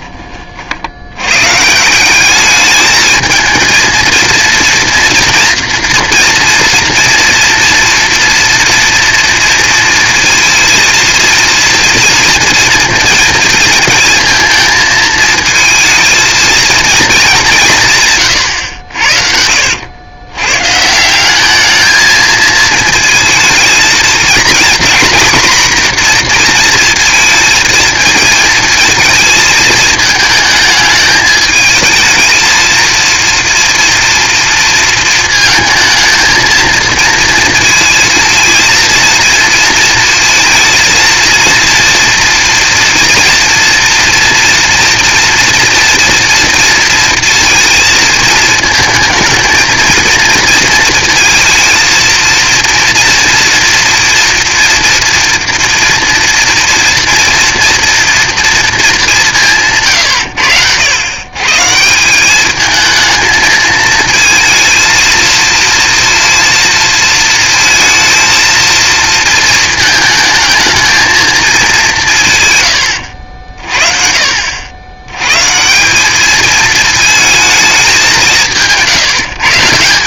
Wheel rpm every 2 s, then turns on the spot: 60, 210, 230, 230, 230, 230, 230, 220, 230, 90, 140, 220, 240, 230, 220, 220, 230, 230, 230, 230, 230, 230, 230, 230, 220, 230, 230, 230, 230, 230, 90, 210, 220, 230, 220, 220, 120, 80, 220, 160.
18-20